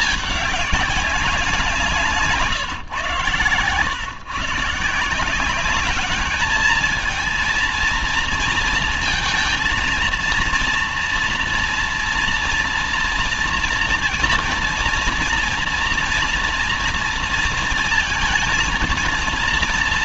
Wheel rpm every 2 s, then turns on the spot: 210, 130, 160, 210, 230, 230, 230, 230, 230, 220.
none